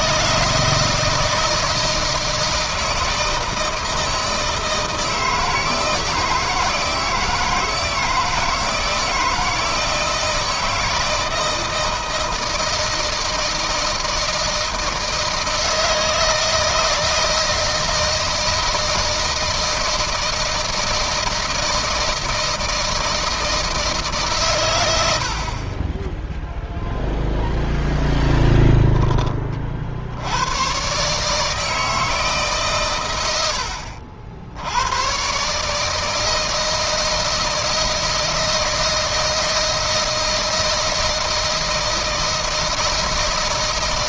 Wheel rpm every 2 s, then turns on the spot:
160, 160, 160, 160, 160, 160, 160, 160, 160, 160, 160, 160, 120, 0, 10, 100, 140, 80, 160, 160, 160, 160.
none